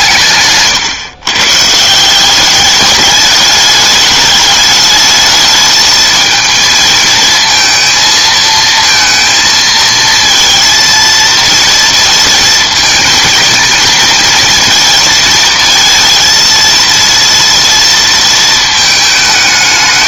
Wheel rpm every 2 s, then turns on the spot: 140, 210, 210, 220, 230, 230, 230, 230, 230, 220.
none